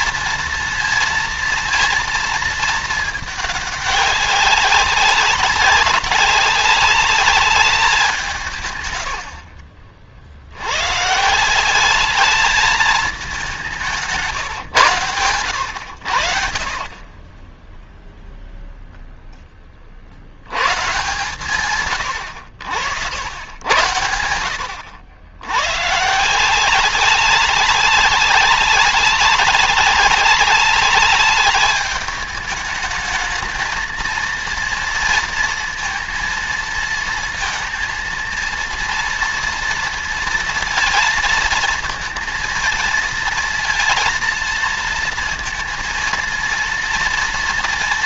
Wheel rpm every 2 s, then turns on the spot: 230, 220, 200, 200, 160, 70, 210, 140, 50, 0, 110, 100, 90, 170, 190, 200, 210, 230, 230, 230, 230, 230, 230, 230.
none